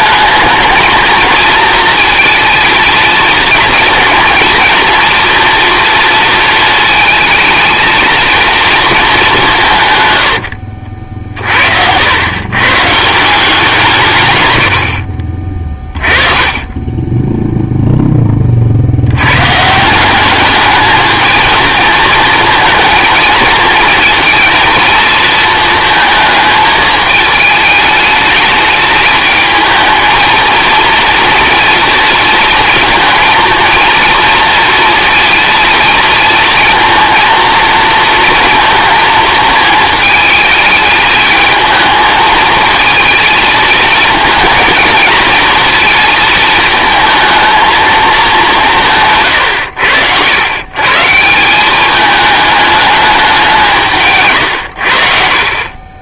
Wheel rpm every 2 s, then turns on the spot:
220, 230, 230, 230, 230, 60, 130, 80, 20, 50, 210, 230, 230, 220, 210, 230, 220, 230, 230, 220, 210, 220, 220, 230, 180, 110, 210, 120.
10-12 54-56